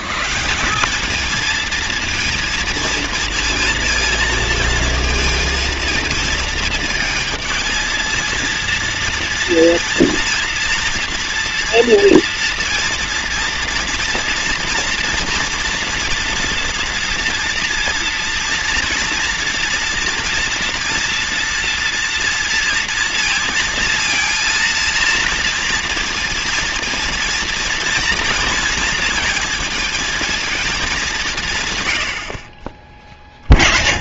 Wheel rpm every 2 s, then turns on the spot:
190, 230, 220, 220, 230, 240, 230, 230, 230, 230, 230, 230, 230, 230, 230, 210, 30.
32-34